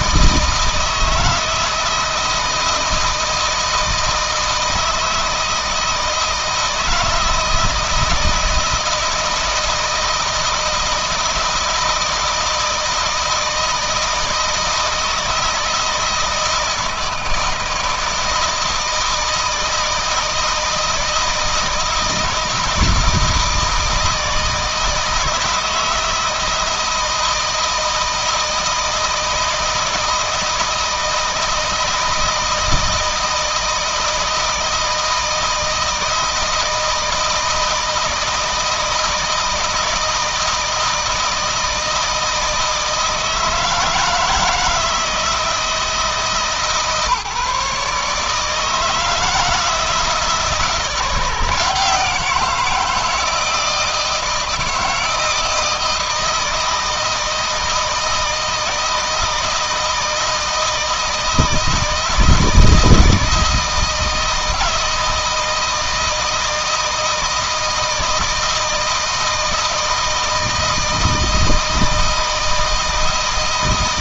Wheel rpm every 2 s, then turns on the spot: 160, 160, 160, 160, 160, 160, 160, 160, 160, 160, 160, 160, 160, 160, 160, 160, 160, 160, 160, 160, 160, 160, 160, 150, 160, 160, 160, 170, 160, 160, 160, 160, 160, 160, 160, 160, 160.
none